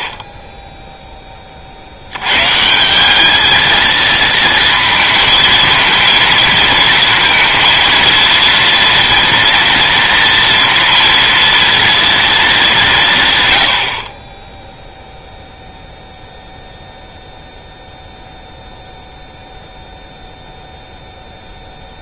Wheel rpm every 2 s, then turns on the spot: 0, 150, 230, 230, 230, 230, 200, 10, 0, 0, 0.
none